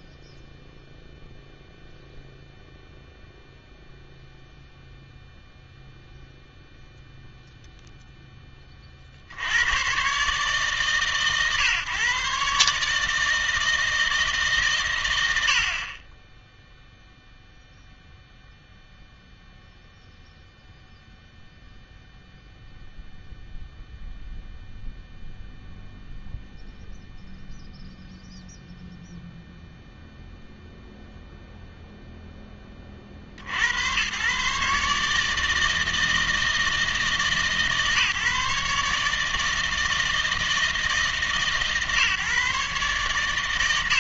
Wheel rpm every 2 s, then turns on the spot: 0, 0, 0, 0, 30, 140, 140, 120, 0, 0, 0, 0, 0, 0, 0, 0, 20, 150, 160, 150, 160, 130.
none